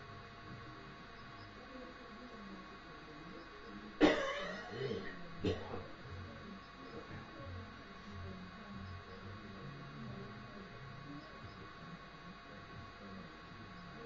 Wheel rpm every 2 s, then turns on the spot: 0, 0, 0, 0, 0, 0, 0.
none